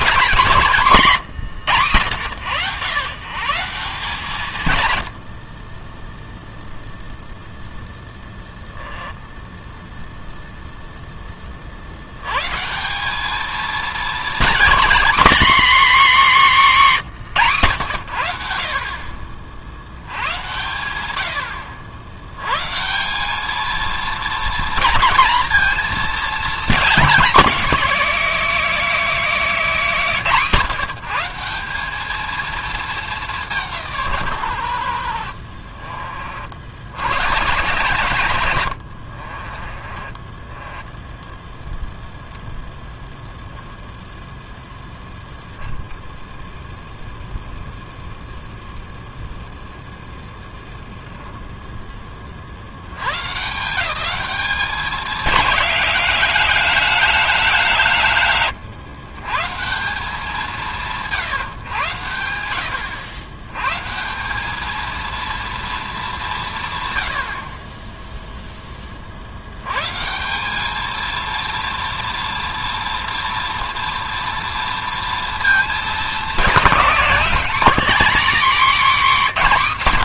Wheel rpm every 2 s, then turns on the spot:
180, 110, 130, 0, 10, 0, 160, 230, 210, 60, 100, 140, 230, 230, 240, 190, 220, 80, 70, 90, 20, 0, 0, 0, 0, 0, 90, 200, 200, 140, 170, 80, 220, 100, 50, 230, 230, 230, 210, 260.
8-10 38-42